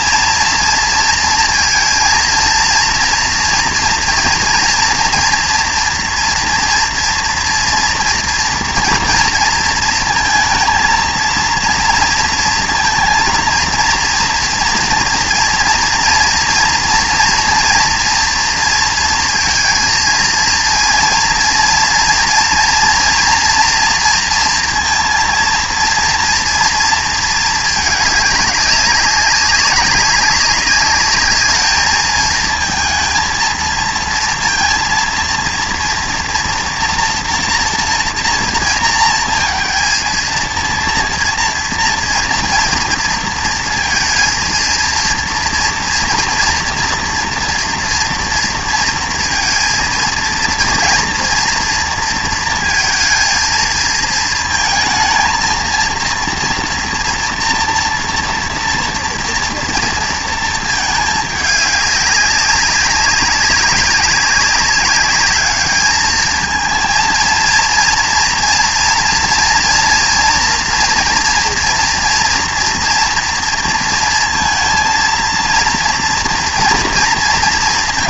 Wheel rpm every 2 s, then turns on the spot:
230, 230, 230, 240, 230, 230, 230, 230, 230, 230, 230, 230, 230, 230, 200, 200, 230, 230, 240, 230, 230, 230, 230, 230, 230, 230, 230, 230, 230, 230, 220, 190, 200, 220, 230, 230, 240, 230, 240.
none